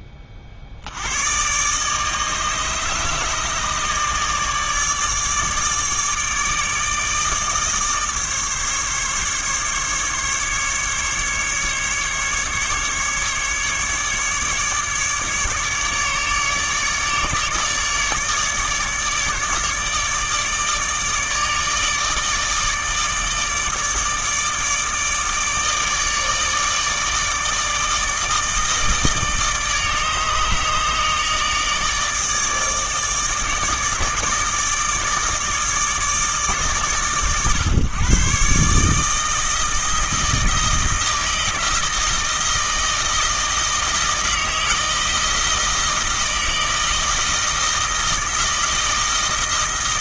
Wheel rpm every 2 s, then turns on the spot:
70, 150, 150, 160, 150, 150, 150, 150, 150, 150, 150, 150, 150, 150, 160, 150, 160, 160, 130, 150, 160, 160, 160, 160, 160.
none